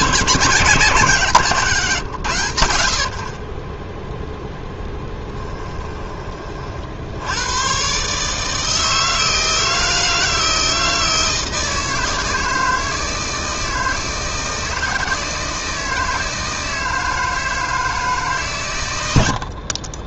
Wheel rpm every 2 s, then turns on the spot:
150, 70, 10, 60, 160, 160, 160, 160, 160, 100.
4-6